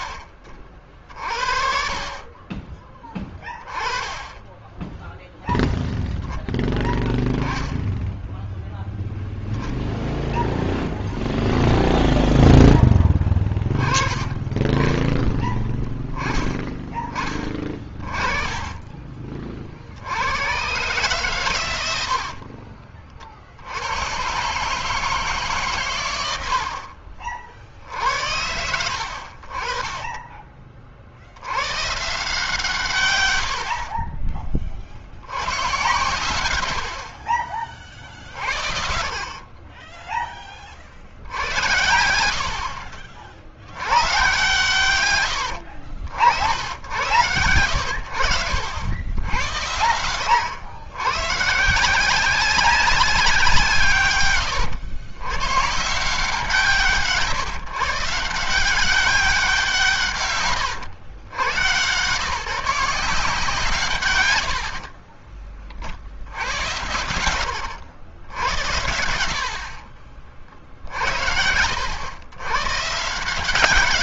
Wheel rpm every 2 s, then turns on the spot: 50, 20, 10, 0, 0, 10, 10, 20, 20, 40, 130, 40, 150, 70, 90, 50, 130, 60, 70, 60, 40, 50, 110, 90, 80, 110, 180, 110, 150, 190, 110, 170, 60, 90, 70, 60, 140.
0-2 36-38 64-66